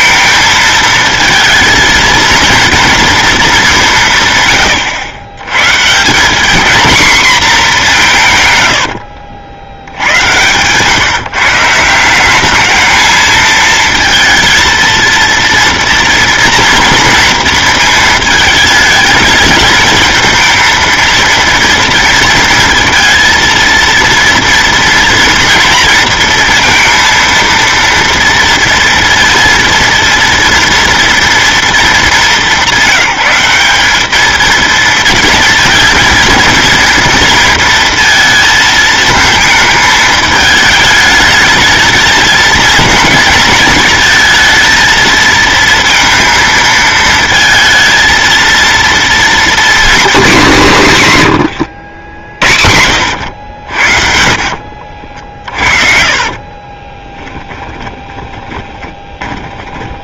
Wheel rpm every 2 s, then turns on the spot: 220, 230, 120, 230, 120, 120, 210, 230, 230, 220, 220, 230, 230, 230, 230, 230, 190, 220, 230, 230, 210, 220, 220, 220, 230, 200, 70, 50, 40, 20.
54-60